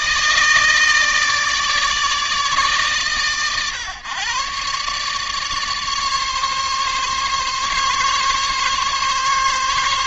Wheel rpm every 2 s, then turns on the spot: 160, 150, 130, 140, 140.
none